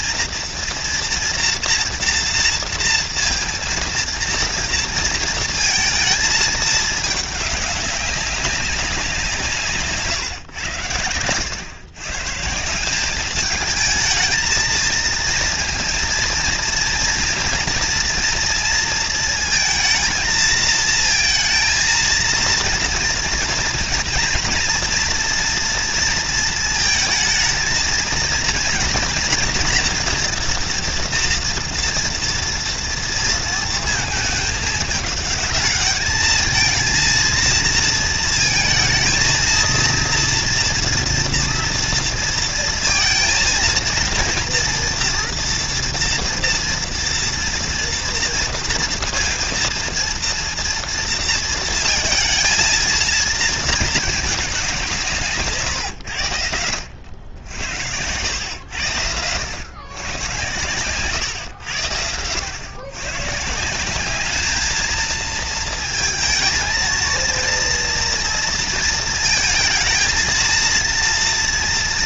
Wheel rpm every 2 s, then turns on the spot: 240, 230, 230, 220, 190, 110, 180, 230, 230, 230, 230, 240, 240, 220, 230, 230, 230, 210, 220, 230, 230, 230, 230, 230, 230, 230, 230, 180, 90, 100, 120, 120, 220, 230, 230, 230.
none